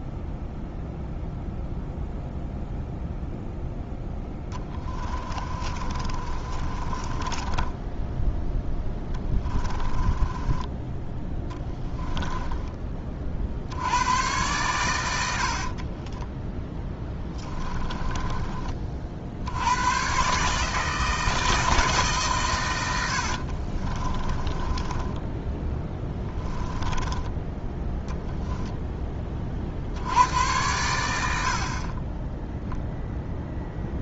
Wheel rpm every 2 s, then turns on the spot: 0, 0, 20, 30, 10, 10, 20, 100, 10, 40, 160, 90, 20, 10, 10, 90, 0.
4-12 22-28